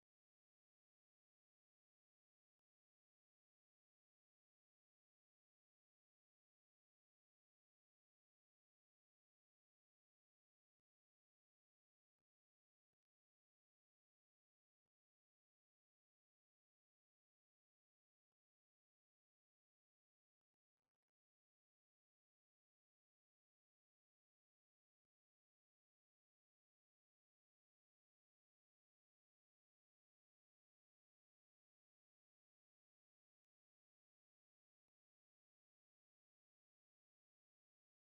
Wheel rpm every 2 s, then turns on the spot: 0, 0, 0, 0, 0, 0, 0, 0, 0, 0, 0, 0, 0, 0, 0, 0, 0, 0, 0.
none